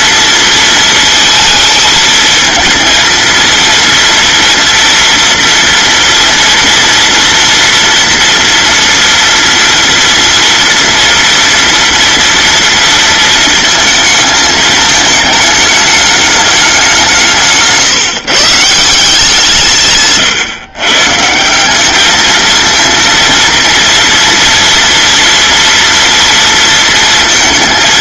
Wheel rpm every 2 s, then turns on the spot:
230, 220, 230, 230, 230, 230, 230, 220, 190, 160, 140, 230, 230, 230.
none